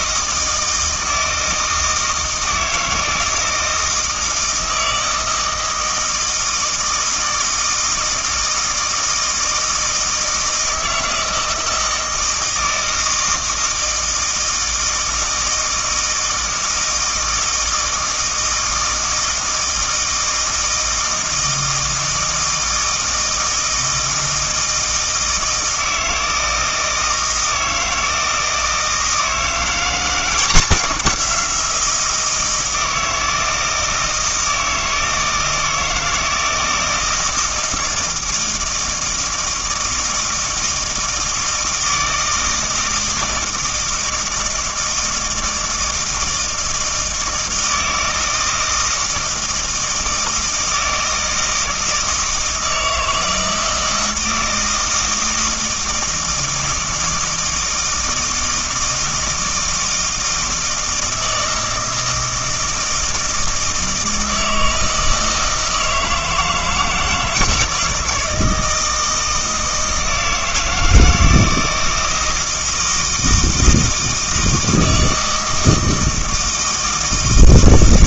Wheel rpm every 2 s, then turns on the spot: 160, 160, 160, 160, 160, 160, 160, 160, 160, 160, 160, 160, 160, 160, 160, 180, 160, 160, 160, 160, 160, 160, 160, 160, 160, 160, 160, 160, 160, 160, 160, 160, 160, 160, 160, 160, 160, 160, 160.
none